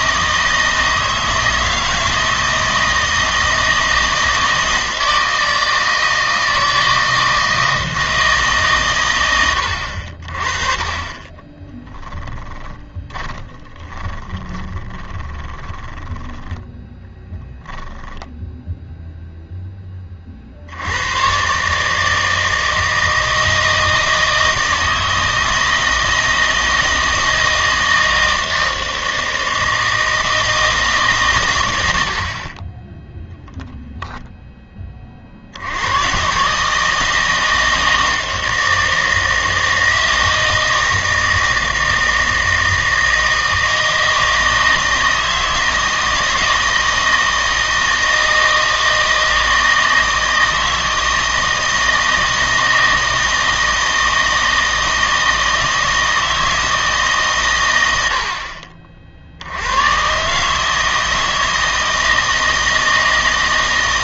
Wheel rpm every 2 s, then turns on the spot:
160, 160, 160, 160, 150, 40, 30, 30, 10, 0, 60, 160, 160, 160, 160, 160, 30, 20, 150, 160, 160, 160, 160, 160, 160, 160, 160, 160, 160, 50, 150, 160.
12-18